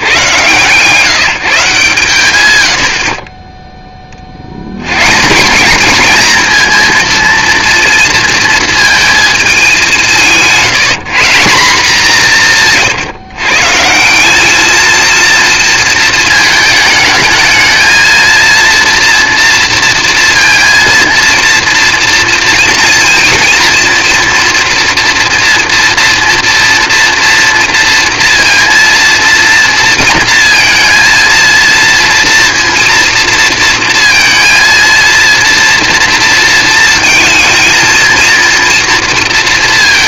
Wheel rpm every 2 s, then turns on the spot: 120, 80, 110, 230, 230, 180, 160, 220, 220, 230, 230, 230, 230, 230, 230, 230, 230, 230, 220, 230.
12-14